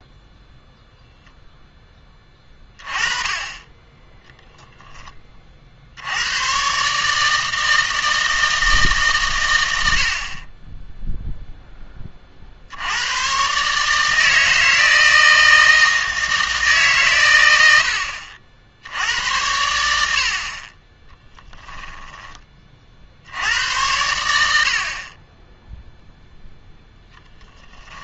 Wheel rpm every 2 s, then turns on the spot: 0, 20, 10, 140, 150, 20, 70, 160, 140, 70, 30, 40, 50, 0.
none